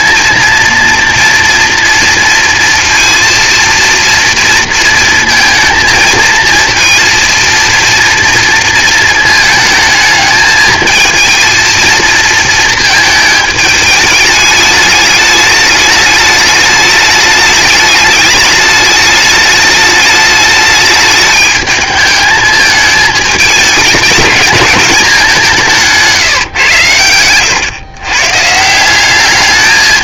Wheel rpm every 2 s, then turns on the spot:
230, 230, 230, 230, 230, 220, 220, 210, 210, 210, 210, 220, 210, 130, 170.
26-28